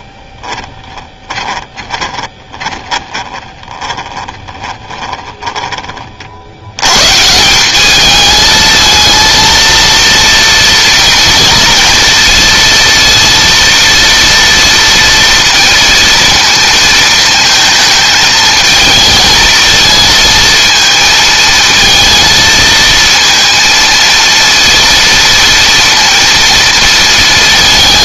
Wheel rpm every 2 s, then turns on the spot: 20, 20, 20, 100, 220, 230, 230, 240, 230, 220, 220, 230, 230, 230.
0-6